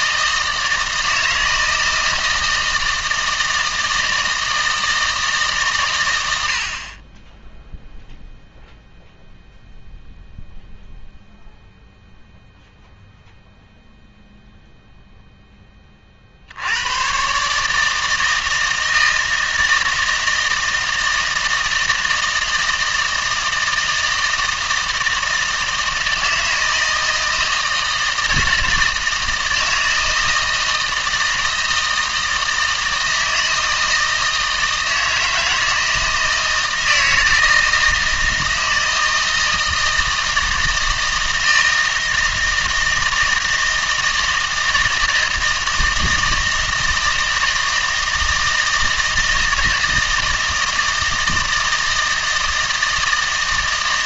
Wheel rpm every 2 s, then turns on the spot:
160, 160, 160, 60, 0, 0, 0, 0, 90, 160, 160, 160, 160, 160, 160, 160, 160, 160, 160, 160, 160, 160, 160, 160, 160, 160, 160.
none